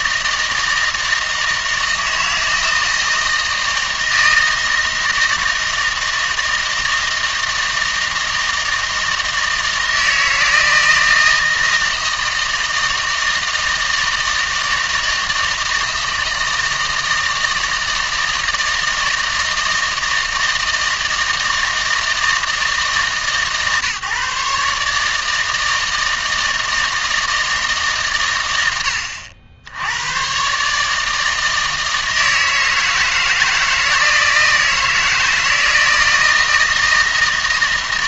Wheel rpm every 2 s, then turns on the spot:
160, 160, 160, 160, 160, 160, 160, 160, 160, 160, 160, 160, 150, 160, 90, 150, 160, 160, 160.
none